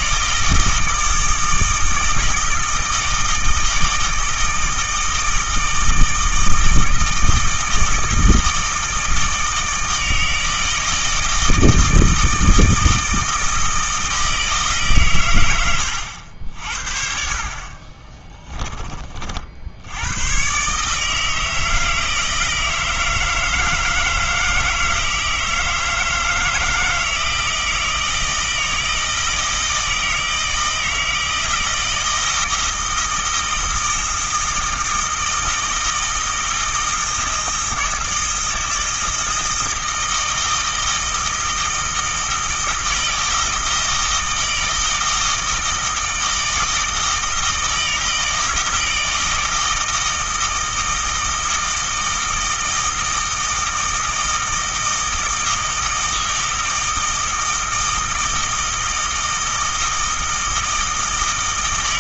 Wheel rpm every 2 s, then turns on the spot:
160, 160, 160, 160, 160, 160, 160, 150, 50, 20, 140, 160, 160, 160, 160, 160, 160, 160, 160, 160, 160, 160, 160, 160, 160, 160, 160, 160, 160, 160, 160.
none